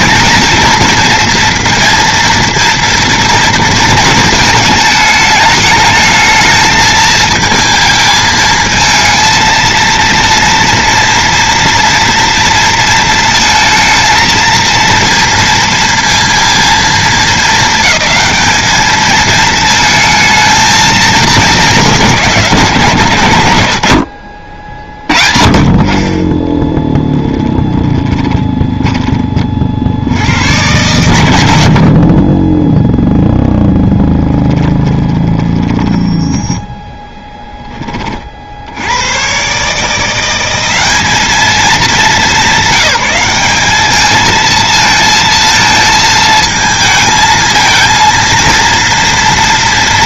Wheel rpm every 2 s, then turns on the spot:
230, 230, 220, 220, 220, 230, 230, 230, 230, 220, 230, 160, 40, 20, 20, 110, 10, 20, 10, 50, 190, 180, 220, 220, 230.
26-30 34-38